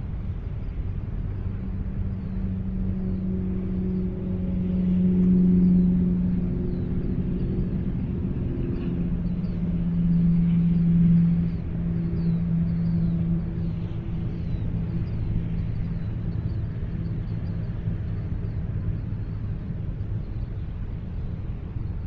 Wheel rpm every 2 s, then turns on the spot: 0, 0, 0, 0, 0, 0, 0, 0, 0, 0, 0.
none